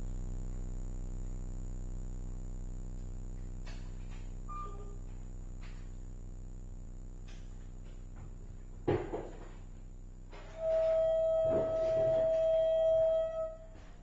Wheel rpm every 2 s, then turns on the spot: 0, 0, 0, 0, 0, 0, 0.
none